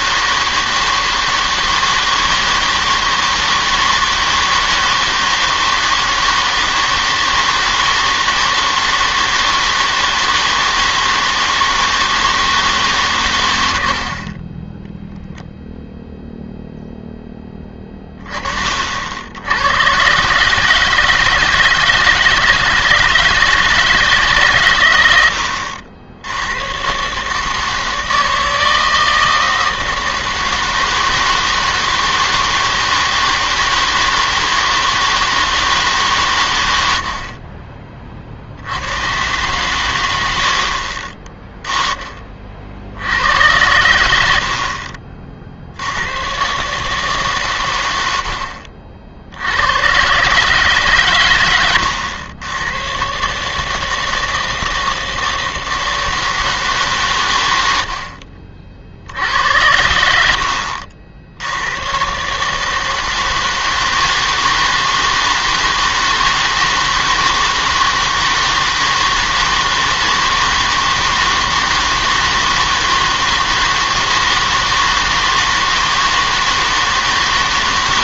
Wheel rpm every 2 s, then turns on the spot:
160, 160, 160, 160, 160, 160, 160, 20, 0, 40, 150, 160, 120, 100, 160, 160, 160, 160, 110, 80, 70, 50, 60, 140, 60, 150, 110, 160, 160, 50, 70, 150, 160, 160, 160, 160, 160, 160, 160.
none